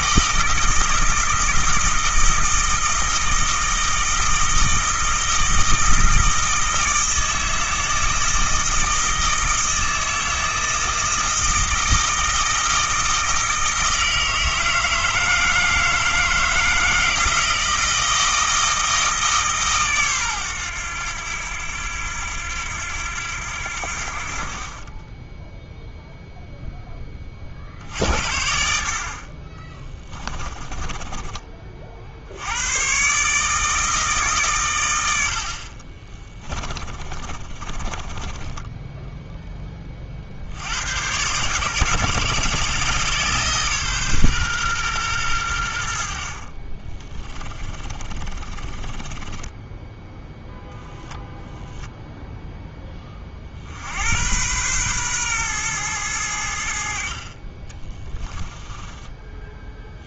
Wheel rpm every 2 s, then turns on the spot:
160, 160, 160, 160, 160, 160, 160, 160, 160, 160, 100, 90, 30, 20, 50, 20, 120, 100, 30, 10, 100, 140, 110, 20, 20, 0, 20, 120, 60, 20.
30-32 36-38 46-50